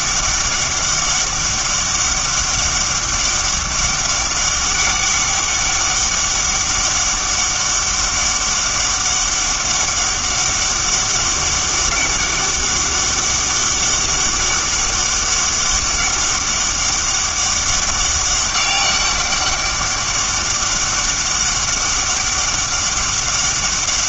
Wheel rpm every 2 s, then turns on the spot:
200, 200, 200, 200, 200, 200, 200, 200, 200, 200, 200, 200.
none